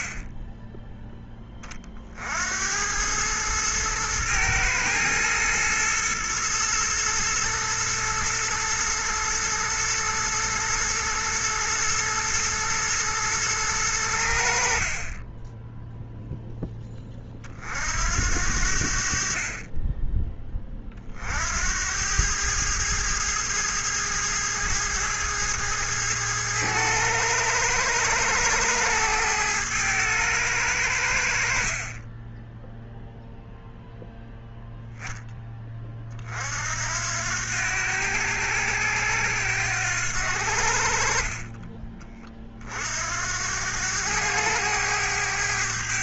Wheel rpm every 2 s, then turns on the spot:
20, 110, 120, 110, 110, 120, 110, 10, 30, 50, 60, 110, 110, 110, 110, 70, 0, 10, 80, 90, 40, 60, 100.
none